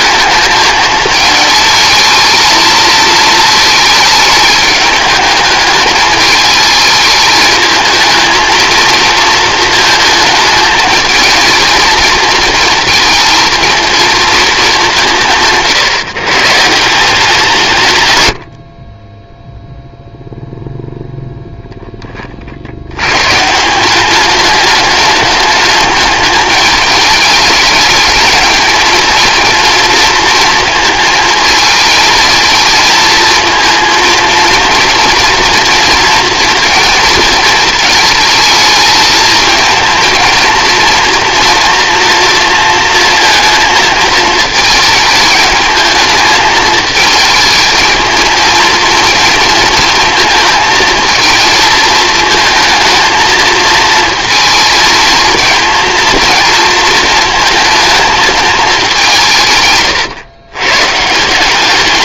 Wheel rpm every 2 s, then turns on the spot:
220, 220, 210, 220, 220, 220, 230, 220, 140, 80, 0, 40, 200, 210, 220, 230, 220, 230, 230, 220, 230, 240, 220, 220, 220, 220, 220, 220, 230, 220, 110.
none